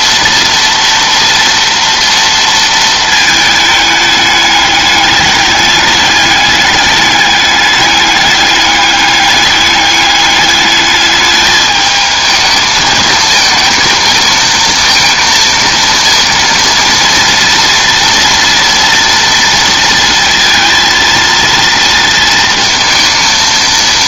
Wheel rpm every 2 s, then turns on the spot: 240, 230, 210, 210, 200, 210, 220, 230, 240, 230, 230, 230.
none